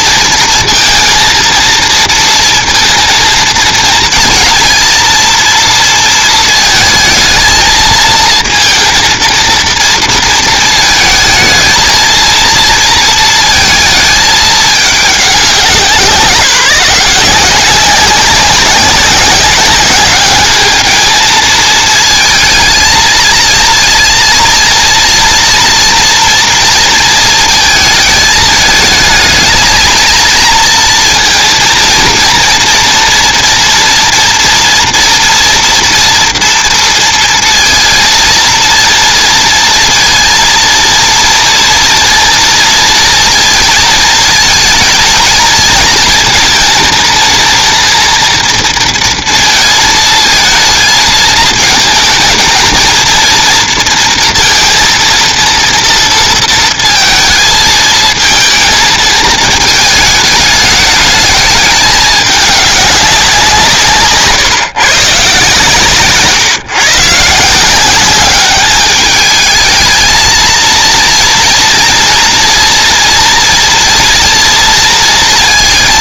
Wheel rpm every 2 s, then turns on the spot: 230, 230, 230, 220, 230, 220, 230, 200, 180, 190, 220, 230, 230, 230, 220, 230, 230, 230, 230, 230, 230, 230, 230, 230, 230, 220, 230, 230, 230, 220, 210, 200, 140, 140, 210, 230, 230, 230.
none